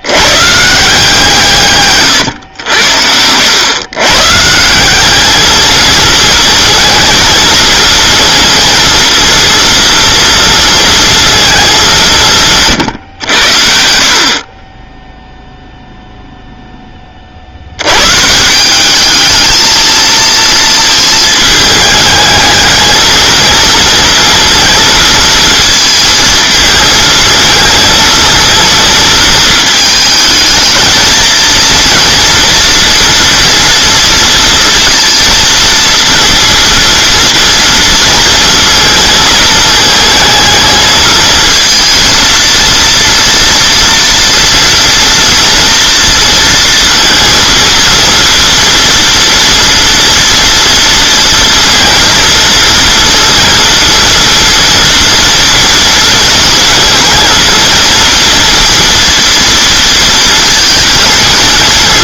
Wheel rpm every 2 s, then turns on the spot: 150, 90, 180, 230, 230, 230, 150, 20, 10, 180, 230, 220, 230, 220, 230, 220, 230, 230, 230, 220, 220, 230, 230, 230, 230, 230, 230, 230, 220, 230, 230.
none